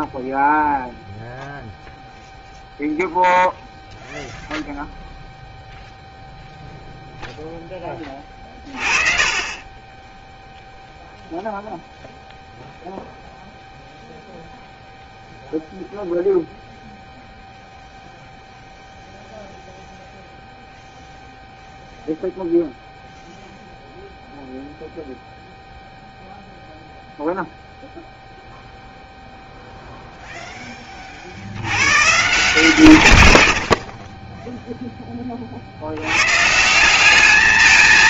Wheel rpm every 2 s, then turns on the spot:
0, 0, 0, 0, 30, 0, 0, 0, 0, 0, 0, 0, 0, 0, 0, 60, 80, 40, 210.
none